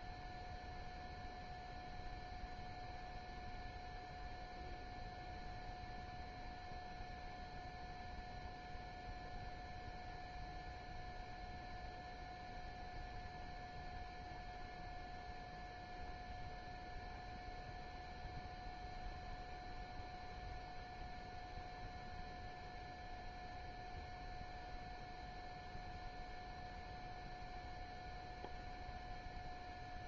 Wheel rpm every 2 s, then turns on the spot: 0, 0, 0, 0, 0, 0, 0, 0, 0, 0, 0, 0, 0, 0, 0.
none